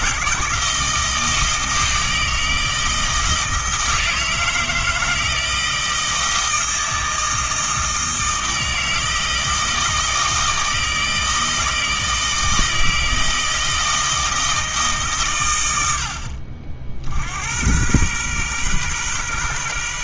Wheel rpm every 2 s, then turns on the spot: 160, 160, 160, 160, 160, 160, 160, 160, 60, 120.
none